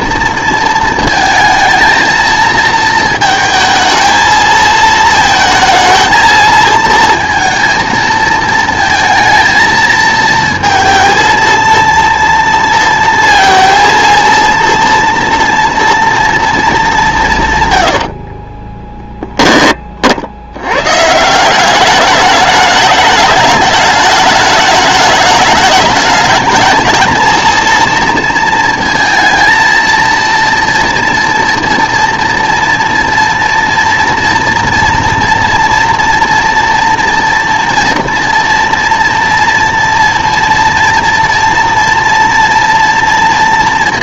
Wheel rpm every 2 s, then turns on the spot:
220, 220, 220, 230, 230, 230, 230, 230, 220, 10, 120, 210, 210, 220, 230, 230, 230, 230, 240, 230, 240, 230.
18-20